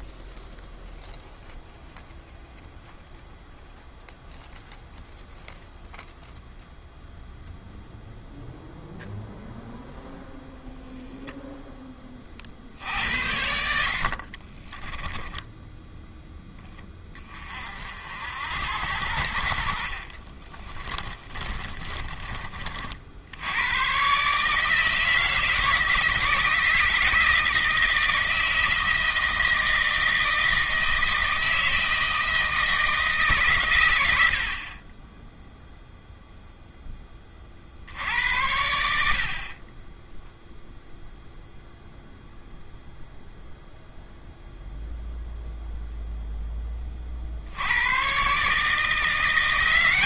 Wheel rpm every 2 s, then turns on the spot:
0, 0, 0, 0, 0, 0, 60, 20, 20, 70, 30, 50, 160, 160, 160, 160, 160, 30, 10, 80, 0, 0, 0, 20, 160.
14-16 20-22